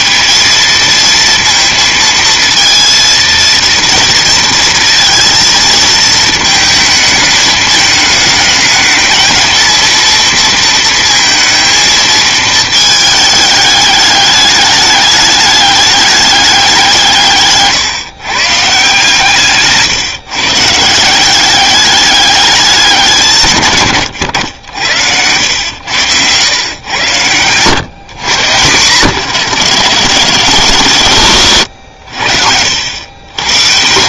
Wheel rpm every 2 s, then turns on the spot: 230, 230, 230, 210, 230, 230, 210, 210, 150, 150, 190, 160, 120, 100, 100, 80, 100.
30-32